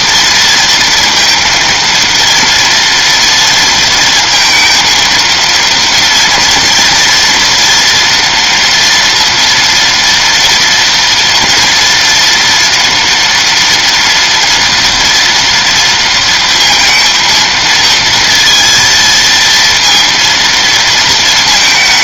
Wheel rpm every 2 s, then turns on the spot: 230, 230, 230, 230, 230, 230, 230, 230, 220, 230, 230.
none